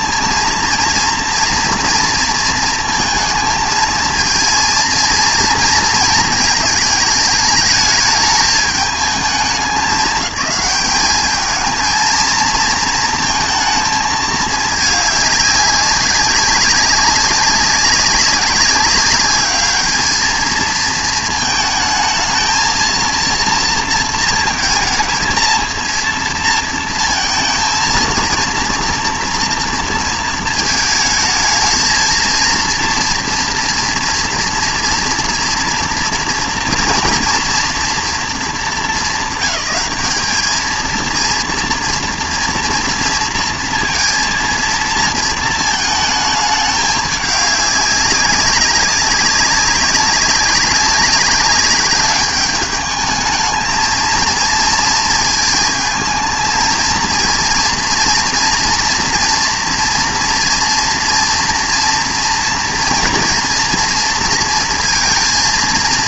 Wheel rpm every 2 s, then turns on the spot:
230, 230, 230, 220, 220, 210, 230, 210, 190, 200, 220, 230, 220, 230, 230, 220, 230, 230, 230, 210, 220, 230, 230, 220, 190, 200, 210, 230, 220, 240, 230, 230, 230.
none